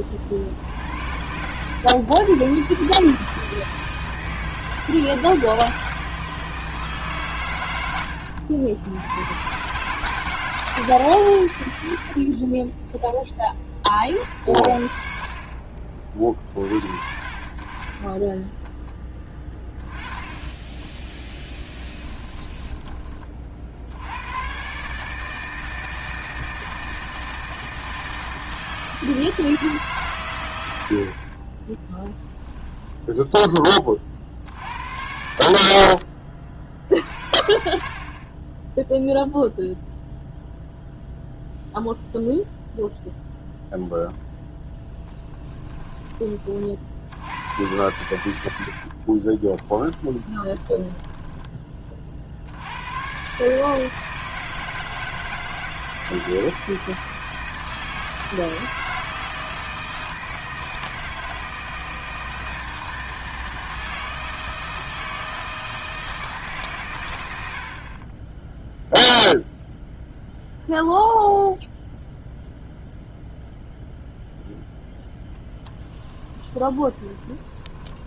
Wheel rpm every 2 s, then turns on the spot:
60, 130, 160, 160, 80, 150, 30, 50, 50, 10, 10, 20, 120, 160, 160, 90, 10, 80, 50, 10, 0, 0, 0, 40, 80, 30, 90, 160, 160, 160, 160, 160, 160, 140, 0, 0, 0, 0, 20.
12-14 22-24 32-34 48-52 76-78